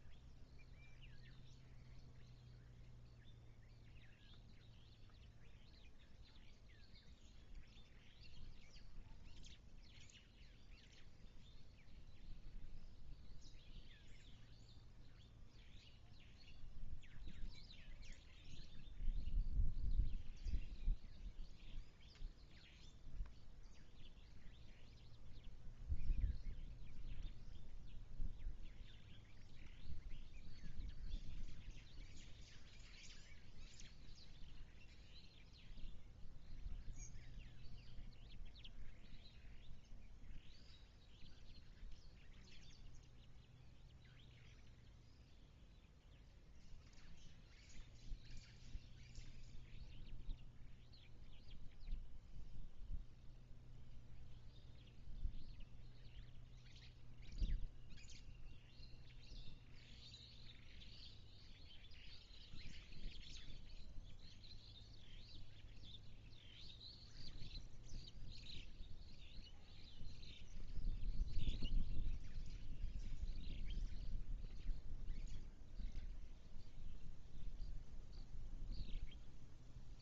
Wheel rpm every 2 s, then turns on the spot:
0, 0, 0, 0, 0, 0, 0, 0, 0, 0, 0, 0, 0, 0, 0, 0, 0, 0, 0, 0, 0, 0, 0, 0, 0, 0, 0, 0, 0, 0, 0, 0, 0, 0, 0, 0, 0, 0, 0, 0.
none